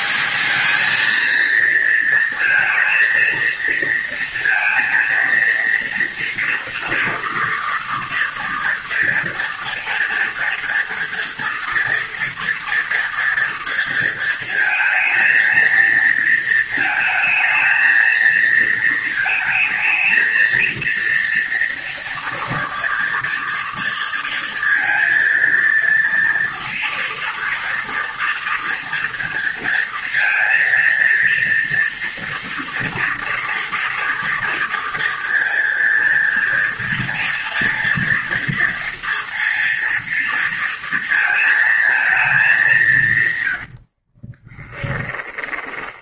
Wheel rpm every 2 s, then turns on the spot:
200, 230, 230, 230, 230, 230, 230, 230, 220, 220, 230, 230, 230, 230, 230, 230, 230, 230, 230, 230, 230, 210, 30.
44-46